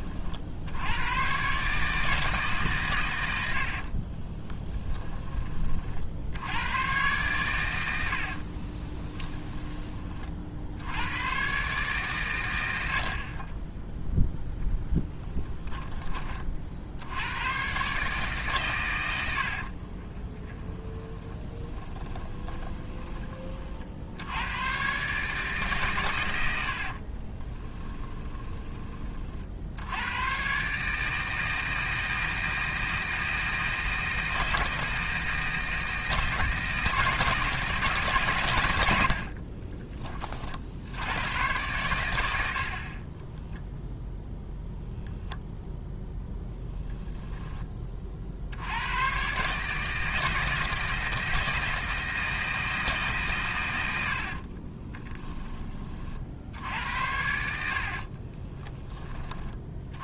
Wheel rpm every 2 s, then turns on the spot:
90, 130, 10, 100, 20, 80, 70, 10, 70, 120, 20, 20, 130, 50, 20, 150, 160, 160, 160, 90, 80, 40, 0, 0, 100, 160, 150, 20, 70, 20.
4-6 8-10 20-24 26-28 54-56